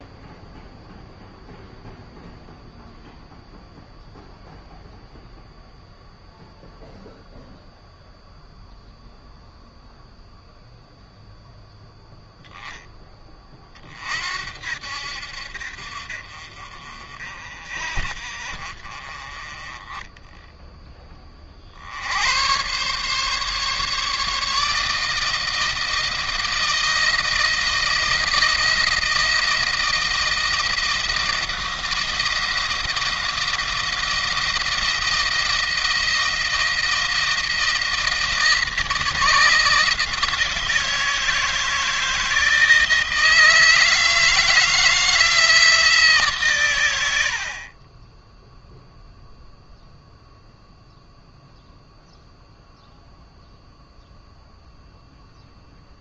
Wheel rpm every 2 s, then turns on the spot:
0, 0, 0, 0, 0, 0, 10, 60, 40, 40, 10, 120, 160, 160, 170, 170, 170, 160, 170, 170, 160, 160, 160, 110, 0, 0, 0, 0.
none